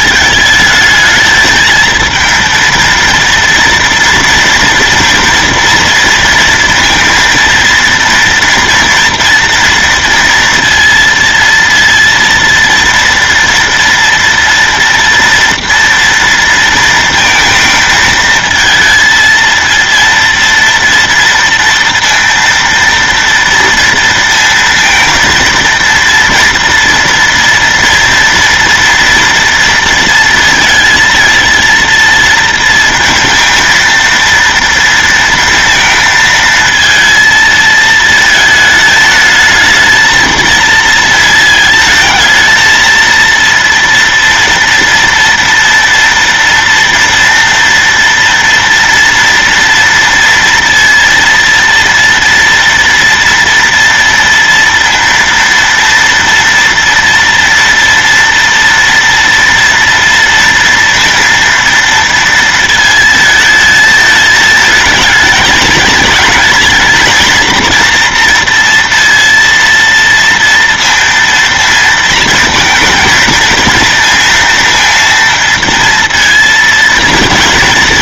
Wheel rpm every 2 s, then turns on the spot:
210, 230, 230, 230, 230, 230, 230, 230, 230, 220, 230, 230, 230, 240, 230, 230, 230, 230, 220, 220, 230, 230, 230, 230, 230, 230, 230, 230, 230, 230, 230, 230, 220, 220, 230, 230, 230, 230, 230.
none